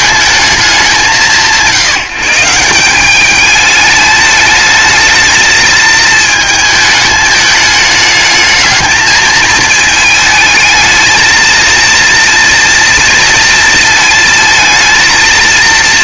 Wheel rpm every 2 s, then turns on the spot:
180, 180, 210, 220, 220, 220, 230, 230.
none